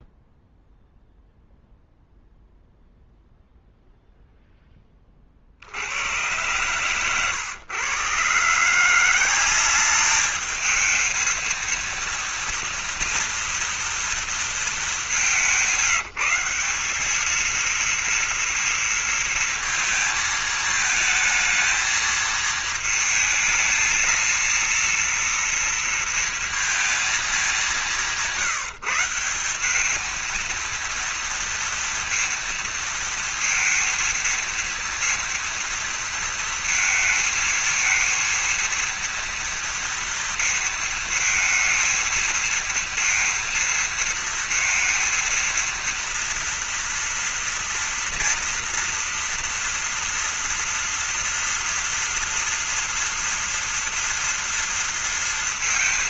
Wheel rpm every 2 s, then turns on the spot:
0, 0, 10, 120, 160, 220, 230, 220, 180, 230, 220, 220, 230, 230, 170, 230, 230, 230, 230, 230, 230, 230, 230, 230, 230, 230, 230, 230.
none